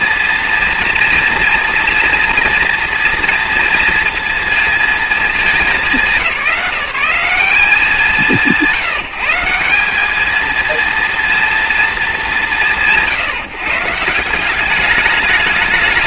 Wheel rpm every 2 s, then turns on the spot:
230, 230, 220, 170, 180, 230, 170, 200.
none